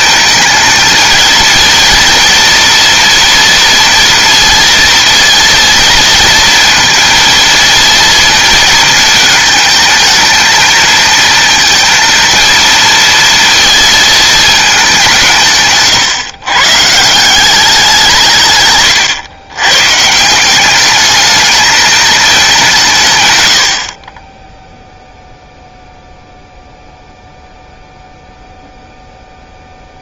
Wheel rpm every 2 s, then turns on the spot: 220, 230, 230, 230, 230, 220, 230, 200, 130, 140, 190, 180, 0, 0, 0.
none